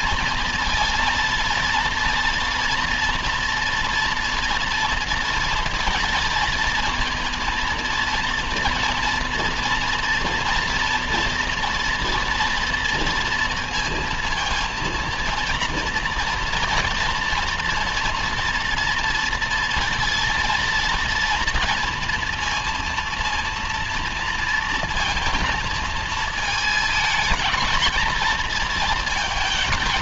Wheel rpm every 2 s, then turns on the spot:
230, 230, 230, 230, 230, 230, 230, 230, 230, 230, 230, 230, 230, 220, 230.
none